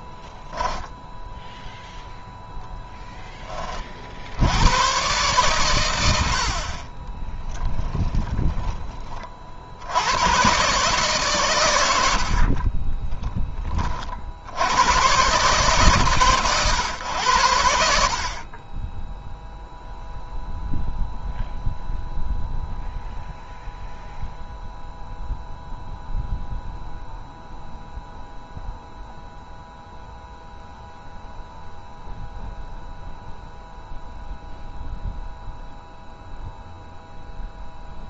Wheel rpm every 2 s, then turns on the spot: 20, 10, 60, 70, 20, 110, 60, 70, 130, 40, 0, 0, 0, 0, 0, 0, 0, 0, 0.
0-2 12-14